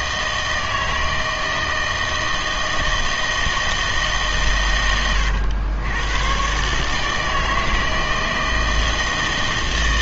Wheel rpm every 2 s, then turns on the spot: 160, 160, 120, 130, 160.
none